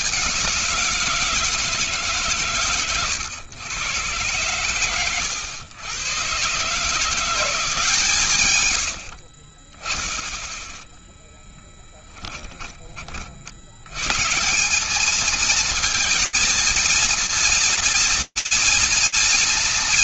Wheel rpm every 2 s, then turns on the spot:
190, 140, 110, 140, 110, 10, 20, 180, 230, 230.
12-14